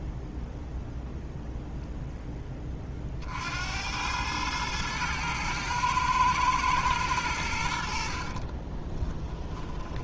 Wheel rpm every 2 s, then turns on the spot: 0, 30, 110, 110, 20.
8-10